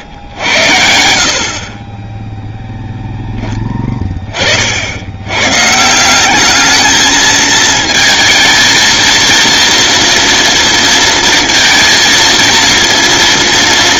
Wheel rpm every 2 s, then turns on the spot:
70, 0, 80, 220, 230, 230, 230.
none